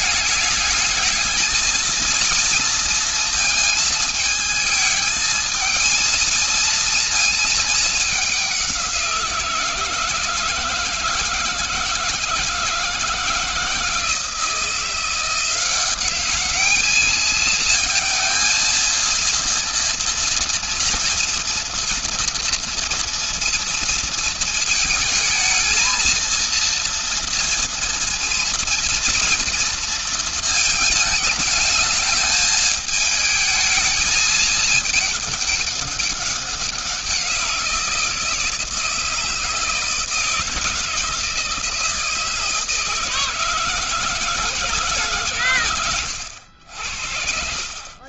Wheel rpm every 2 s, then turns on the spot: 220, 230, 220, 230, 190, 160, 160, 170, 210, 230, 230, 230, 220, 230, 230, 220, 220, 210, 190, 160, 160, 160, 160, 90.
none